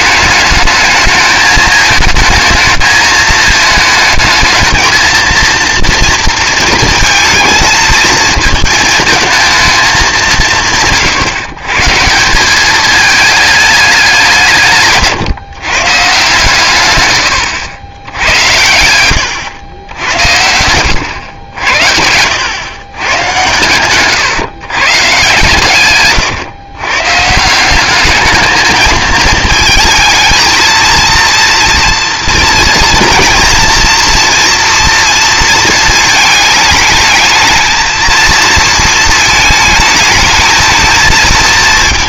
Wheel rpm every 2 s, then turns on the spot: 220, 220, 220, 230, 220, 150, 200, 160, 130, 90, 100, 110, 130, 120, 220, 230, 230, 230, 210, 230, 220.
none